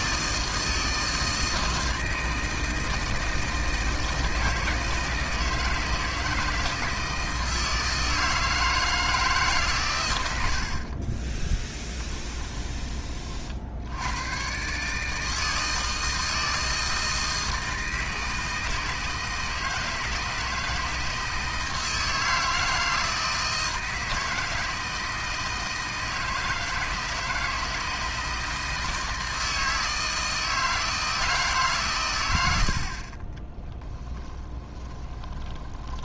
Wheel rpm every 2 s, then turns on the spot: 160, 160, 160, 160, 160, 40, 20, 140, 160, 160, 160, 160, 160, 160, 160, 160, 60, 20.
10-12 34-36